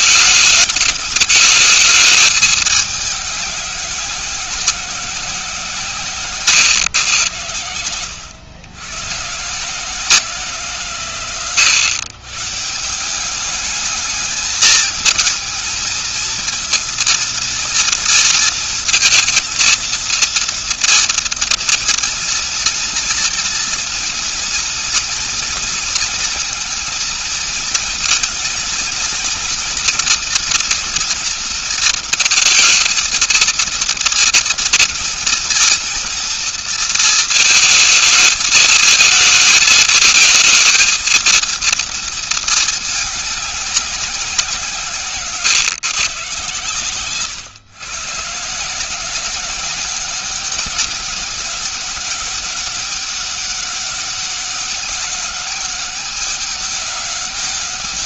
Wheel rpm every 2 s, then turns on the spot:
220, 210, 190, 130, 100, 160, 140, 210, 220, 230, 230, 230, 230, 220, 230, 230, 230, 230, 230, 220, 220, 220, 180, 140, 150, 190, 190, 200, 200.
none